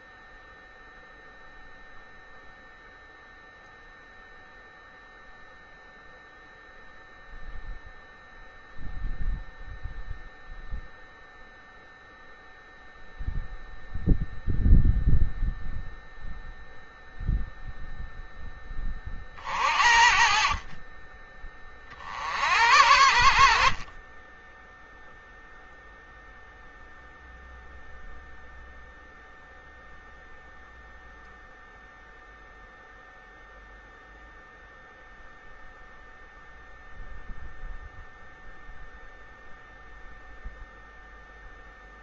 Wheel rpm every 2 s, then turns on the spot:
0, 0, 0, 0, 0, 0, 0, 0, 0, 20, 30, 80, 0, 0, 0, 0, 0, 0, 0, 0, 0.
none